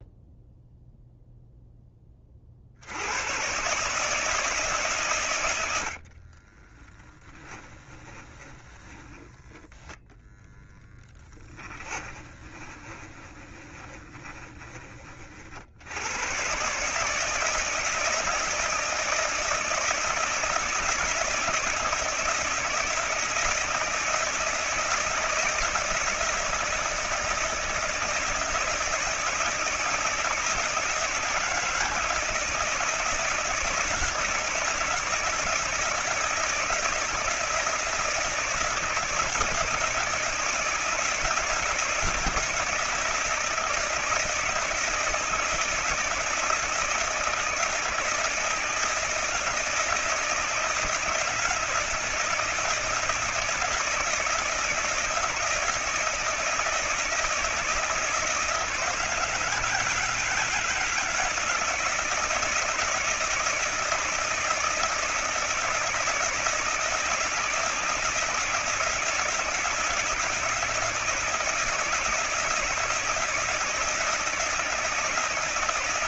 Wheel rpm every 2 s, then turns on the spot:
0, 50, 150, 20, 20, 0, 20, 20, 130, 160, 170, 160, 160, 160, 160, 160, 160, 170, 160, 160, 160, 170, 160, 160, 160, 160, 160, 160, 160, 160, 160, 160, 160, 160, 160, 170, 170, 160.
6-10 12-14